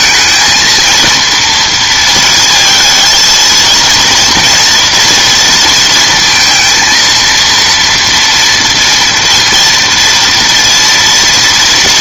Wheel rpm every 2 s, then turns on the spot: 230, 220, 240, 230, 230, 230.
none